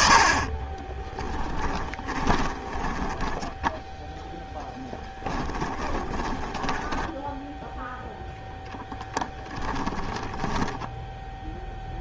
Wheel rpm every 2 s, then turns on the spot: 20, 20, 10, 10, 0, 10.
0-8 10-12